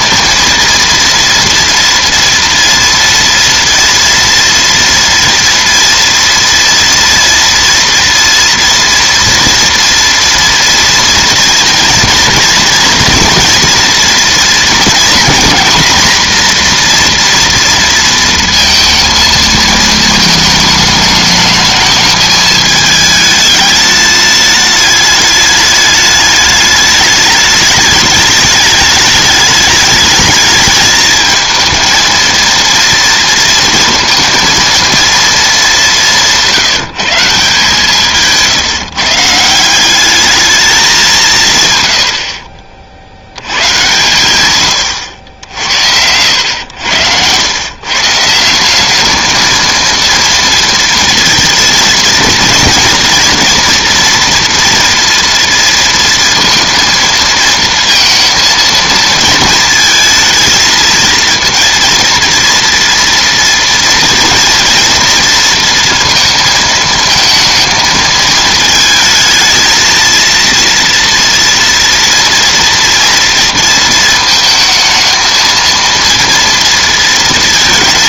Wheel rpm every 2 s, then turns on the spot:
230, 230, 230, 230, 230, 230, 230, 240, 240, 230, 220, 220, 210, 210, 210, 220, 230, 230, 160, 150, 210, 50, 110, 100, 190, 230, 230, 240, 230, 230, 220, 230, 230, 230, 220, 230, 230, 220, 230.
none